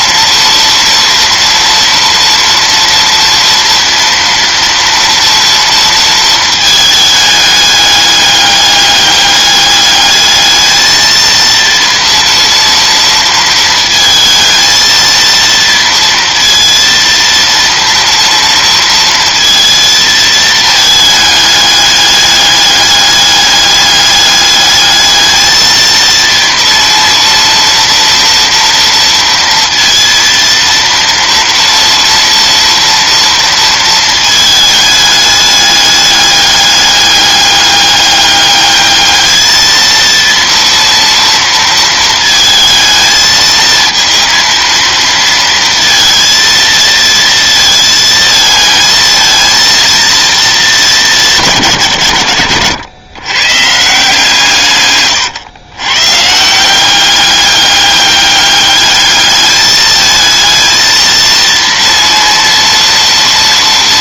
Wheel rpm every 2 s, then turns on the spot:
230, 230, 230, 220, 200, 220, 230, 220, 230, 230, 220, 210, 210, 230, 230, 230, 230, 210, 200, 210, 230, 220, 230, 230, 220, 220, 110, 150, 180, 200, 220, 230.
none